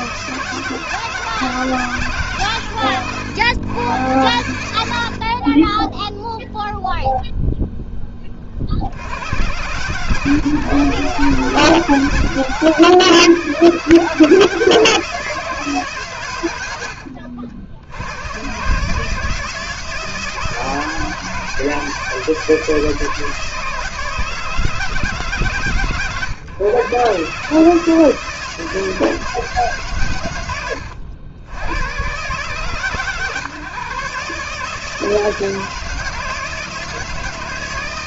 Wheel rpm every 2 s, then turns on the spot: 160, 120, 60, 0, 100, 140, 130, 160, 70, 140, 160, 160, 160, 120, 160, 100, 140, 150, 160.
16-18